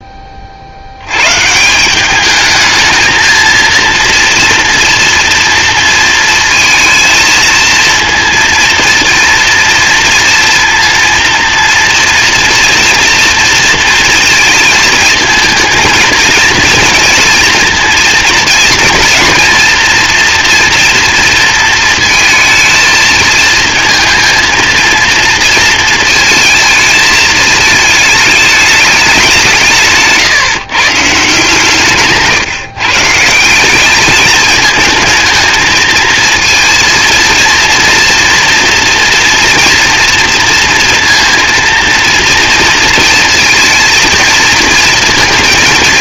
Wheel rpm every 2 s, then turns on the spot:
70, 220, 230, 230, 230, 230, 240, 220, 230, 230, 240, 220, 230, 220, 220, 140, 140, 220, 230, 240, 230, 230, 230.
none